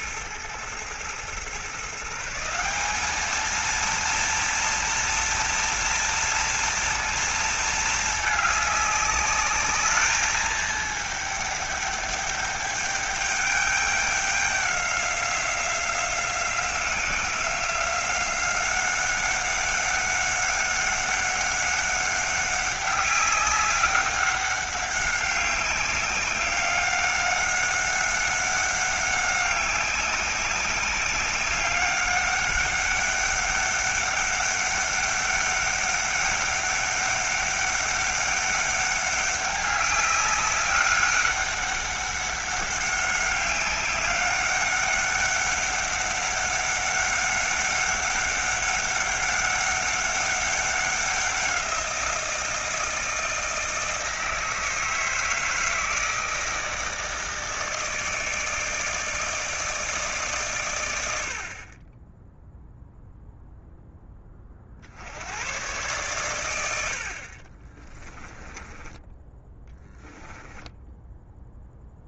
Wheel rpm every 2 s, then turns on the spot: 110, 170, 230, 230, 210, 220, 210, 200, 180, 190, 200, 200, 190, 200, 190, 200, 200, 200, 200, 200, 200, 200, 200, 200, 200, 190, 170, 160, 160, 160, 130, 0, 30, 110, 20, 10.
68-72